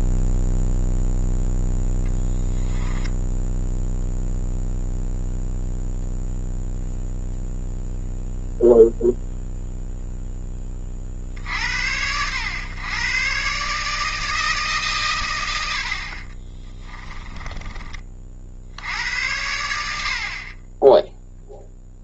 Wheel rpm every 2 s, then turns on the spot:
0, 10, 0, 0, 0, 40, 120, 140, 20, 80, 20.
2-4 16-18